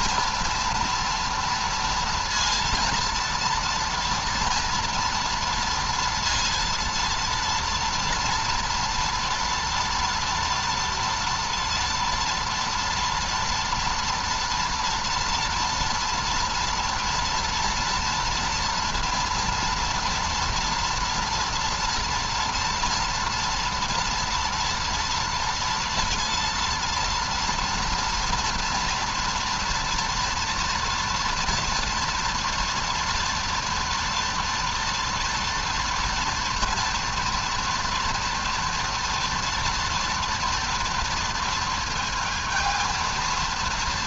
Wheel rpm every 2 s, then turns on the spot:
240, 230, 230, 230, 240, 240, 230, 230, 230, 230, 230, 240, 230, 230, 230, 230, 230, 230, 230, 230, 230, 230.
none